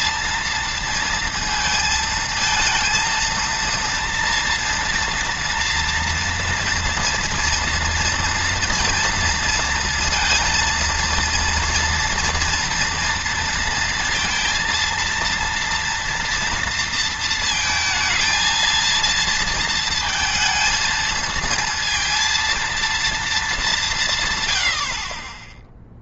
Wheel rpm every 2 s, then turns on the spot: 230, 230, 230, 240, 230, 230, 230, 230, 230, 230, 220, 230, 50.
none